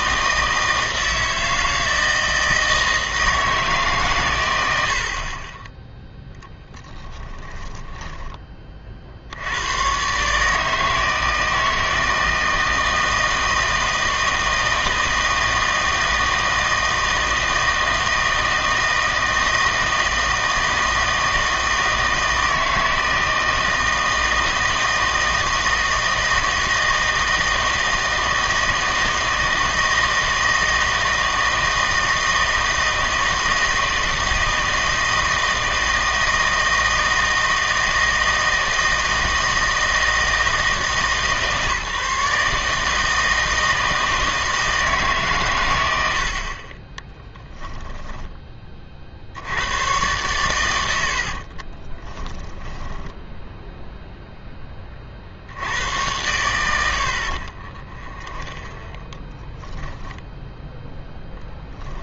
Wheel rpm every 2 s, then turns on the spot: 160, 160, 90, 10, 30, 150, 160, 160, 160, 160, 160, 160, 160, 160, 160, 160, 160, 160, 160, 160, 160, 150, 160, 40, 30, 100, 10, 10, 90, 20, 10.
6-8 52-54 58-60